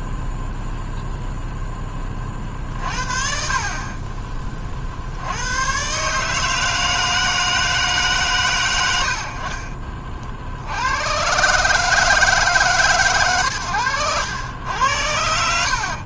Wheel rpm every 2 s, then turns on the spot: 0, 50, 30, 150, 100, 60, 130, 100.
none